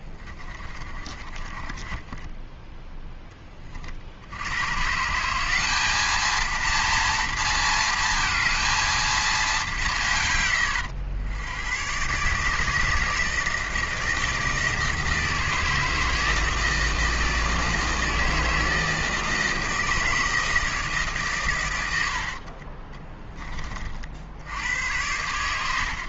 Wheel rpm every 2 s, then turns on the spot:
30, 10, 110, 230, 230, 110, 150, 160, 160, 160, 160, 30, 80.
0-2 22-24